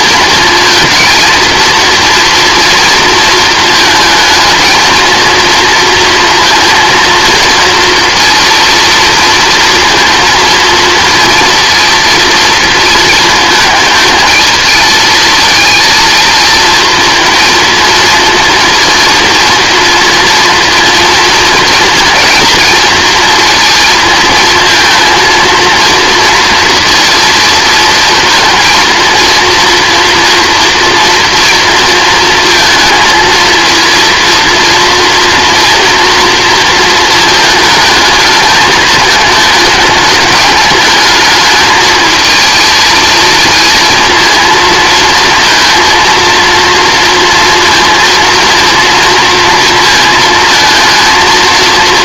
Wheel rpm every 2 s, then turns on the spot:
230, 230, 230, 230, 230, 230, 230, 220, 230, 230, 230, 230, 220, 230, 230, 230, 230, 230, 230, 210, 210, 230, 230, 230, 230, 220.
none